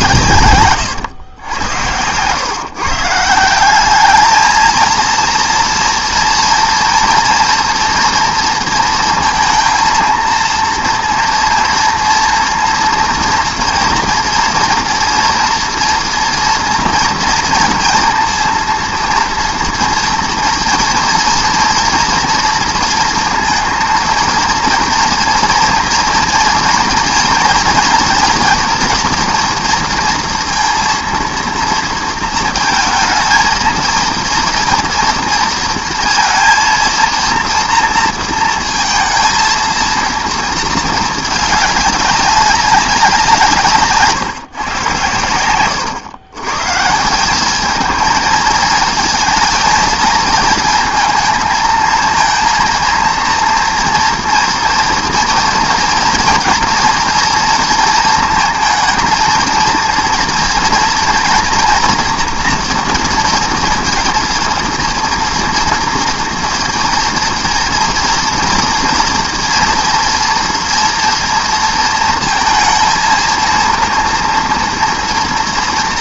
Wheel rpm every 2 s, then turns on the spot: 120, 140, 220, 230, 230, 230, 230, 230, 230, 230, 230, 230, 230, 230, 230, 230, 220, 230, 230, 230, 230, 200, 120, 140, 220, 220, 230, 230, 230, 230, 230, 240, 230, 230, 230, 230, 230, 230.
none